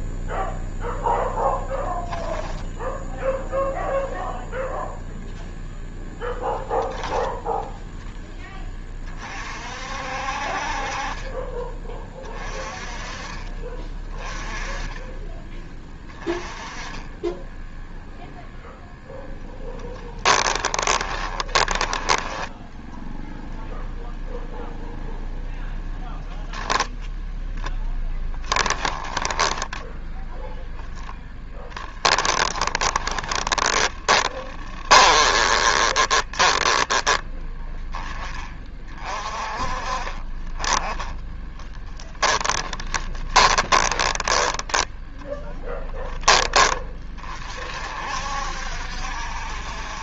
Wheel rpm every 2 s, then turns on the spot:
0, 10, 0, 0, 20, 40, 30, 20, 20, 10, 30, 10, 0, 0, 10, 0, 20, 20, 20, 30, 20, 20, 10, 20, 60.
20-22 28-30 32-38 42-44